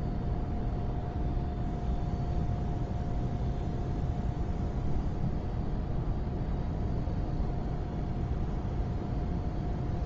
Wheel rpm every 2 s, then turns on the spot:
0, 0, 0, 0, 0.
none